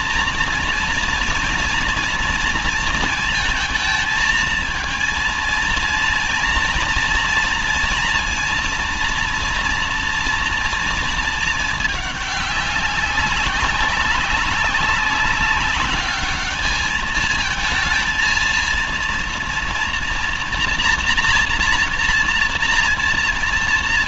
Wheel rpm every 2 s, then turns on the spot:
240, 230, 230, 230, 230, 230, 200, 200, 210, 230, 240, 230.
none